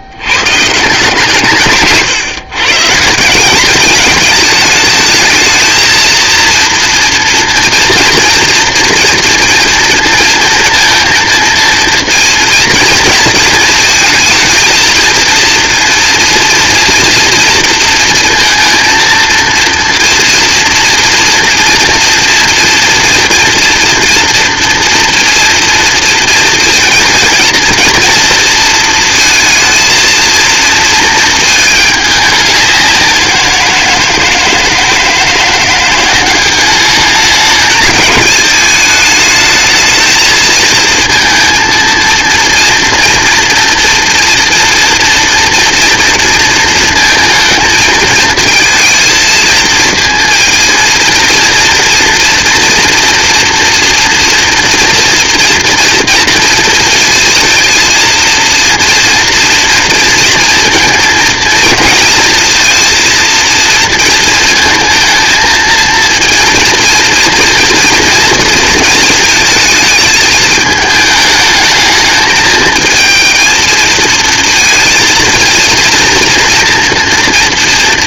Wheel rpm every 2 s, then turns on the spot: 160, 150, 220, 230, 230, 230, 230, 230, 230, 230, 230, 230, 230, 230, 230, 230, 180, 160, 210, 220, 230, 230, 240, 230, 220, 230, 230, 230, 230, 240, 230, 230, 230, 230, 220, 210, 220, 230, 230.
none